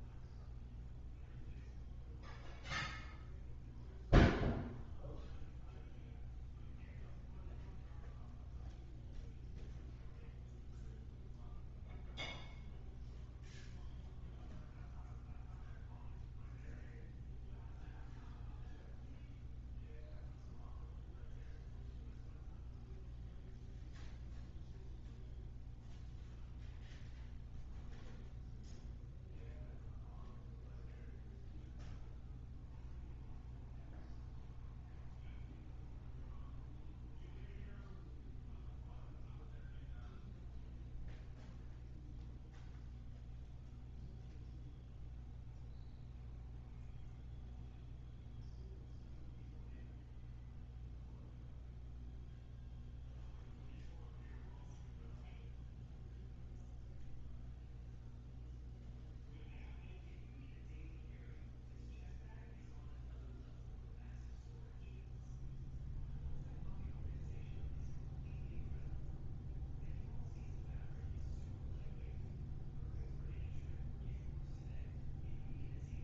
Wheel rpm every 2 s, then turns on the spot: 0, 0, 0, 0, 0, 0, 0, 0, 0, 0, 0, 0, 0, 0, 0, 0, 0, 0, 0, 0, 0, 0, 0, 0, 0, 0, 0, 0, 0, 0, 0, 0, 0, 0, 0, 0, 0, 0.
none